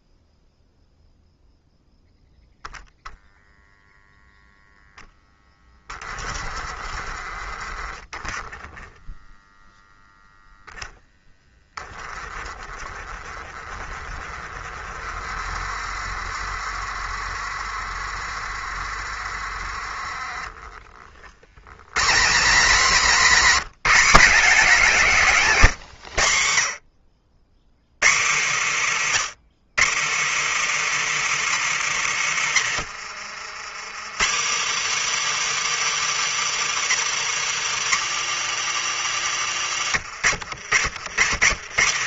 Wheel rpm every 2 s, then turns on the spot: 0, 0, 0, 40, 10, 10, 30, 30, 30, 30, 30, 180, 170, 80, 160, 280, 170, 270, 300, 270, 140.
32-34